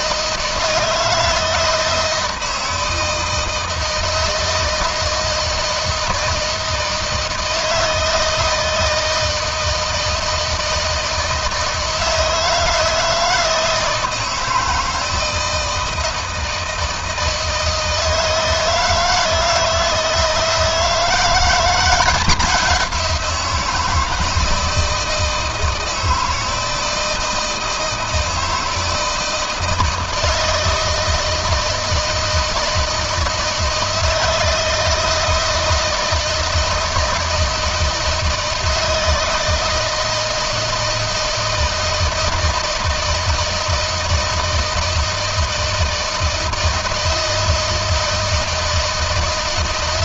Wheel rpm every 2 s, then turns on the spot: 160, 160, 160, 160, 160, 160, 160, 160, 160, 160, 160, 180, 160, 160, 160, 160, 160, 160, 160, 160, 160, 160, 160, 160, 160.
none